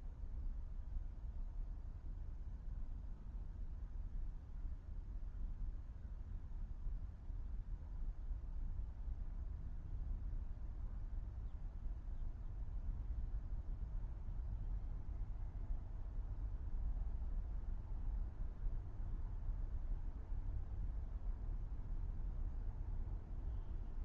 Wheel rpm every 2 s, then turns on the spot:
0, 0, 0, 0, 0, 0, 0, 0, 0, 0, 0, 0.
none